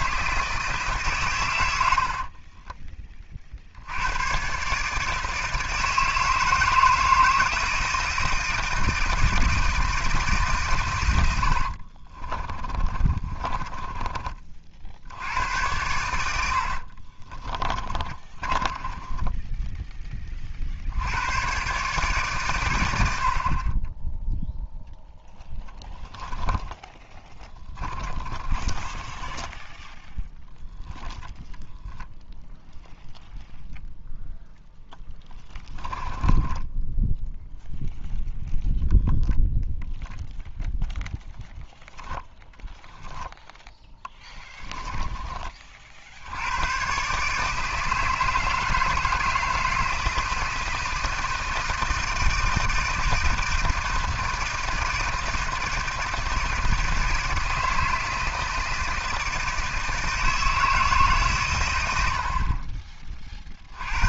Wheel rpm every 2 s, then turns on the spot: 150, 30, 150, 160, 160, 130, 30, 60, 60, 20, 50, 110, 0, 10, 20, 0, 0, 0, 10, 0, 0, 10, 30, 120, 160, 160, 160, 160, 160, 160, 160, 40.
12-14 16-20 26-30 36-38 44-46